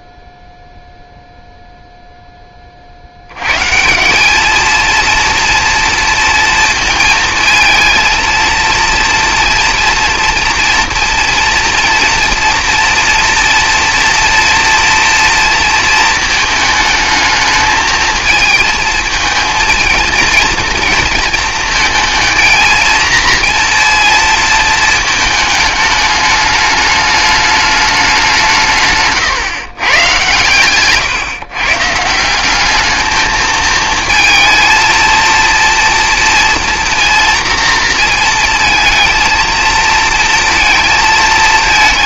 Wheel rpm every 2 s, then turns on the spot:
0, 50, 220, 230, 230, 240, 230, 230, 220, 220, 230, 230, 220, 210, 150, 120, 210, 230, 230, 230, 230.
30-32